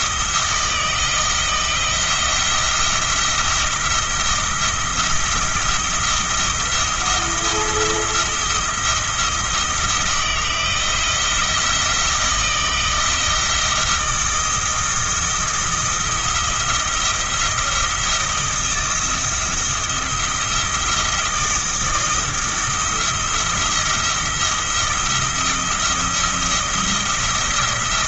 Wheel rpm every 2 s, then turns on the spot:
170, 170, 170, 170, 170, 170, 160, 170, 170, 170, 170, 170, 170, 170.
none